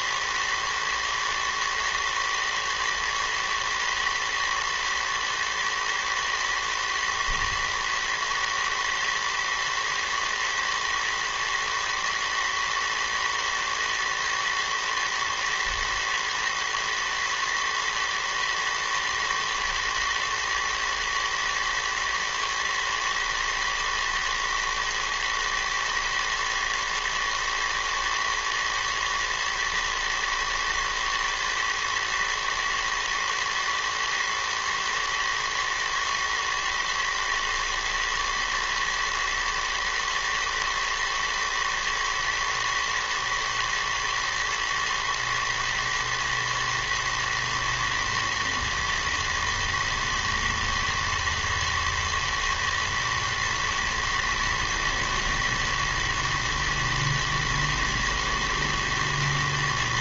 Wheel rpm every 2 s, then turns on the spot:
110, 110, 110, 110, 110, 110, 110, 110, 110, 110, 110, 110, 110, 110, 110, 110, 110, 110, 110, 120, 110, 110, 120, 110, 110, 120, 120, 110, 110, 110.
none